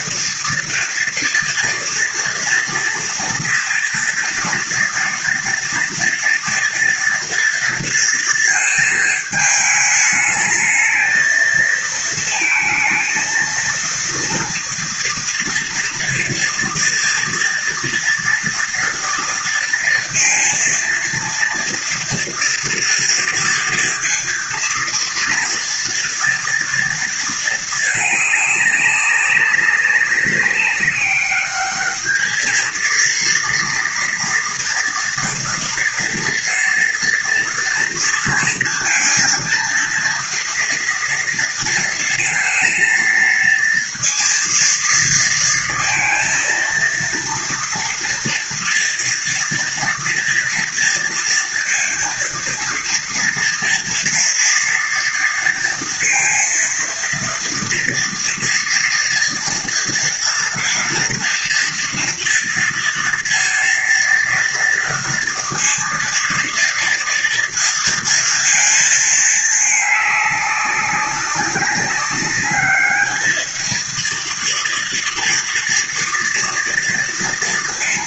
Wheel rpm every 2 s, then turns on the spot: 230, 240, 230, 230, 230, 220, 230, 230, 230, 230, 230, 230, 230, 230, 210, 200, 220, 240, 230, 230, 230, 230, 230, 230, 230, 230, 230, 230, 230, 230, 240, 240, 230, 230, 230, 200, 200, 230, 230.
none